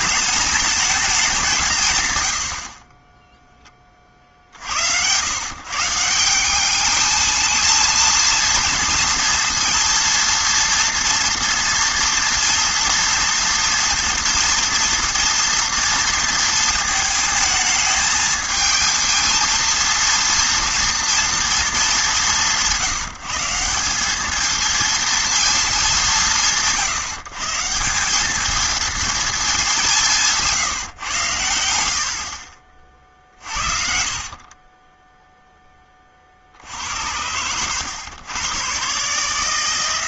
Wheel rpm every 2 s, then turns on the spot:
220, 40, 90, 210, 230, 230, 230, 230, 230, 220, 230, 180, 220, 160, 220, 140, 40, 20, 70, 110.
34-36